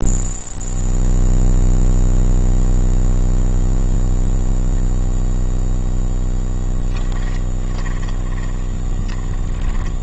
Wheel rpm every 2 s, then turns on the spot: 0, 0, 0, 10, 20.
6-10